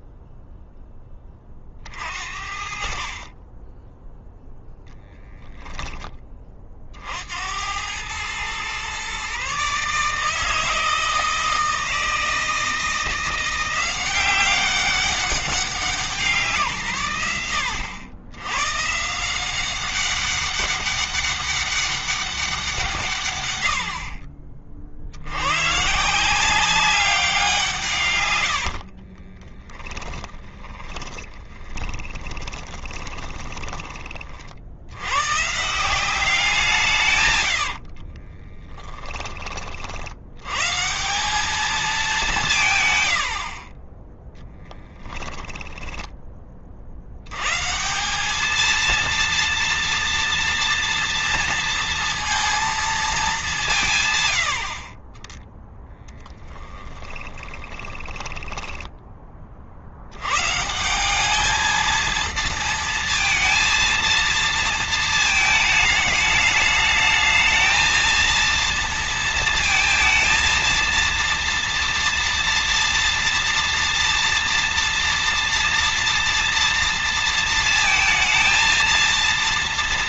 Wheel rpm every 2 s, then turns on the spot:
10, 50, 10, 40, 120, 160, 170, 190, 150, 130, 200, 150, 50, 190, 70, 20, 20, 70, 170, 20, 160, 130, 10, 50, 220, 230, 230, 80, 10, 10, 160, 230, 220, 210, 230, 230, 230, 230, 230, 230.
28-34 38-40 44-46 56-58